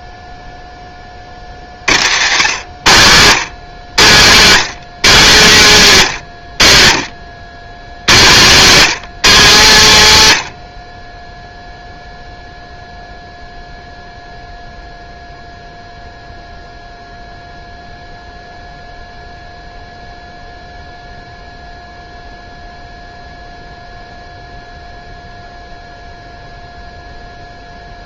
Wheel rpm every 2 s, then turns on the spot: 10, 120, 190, 90, 200, 80, 0, 0, 0, 0, 0, 0, 0, 0.
none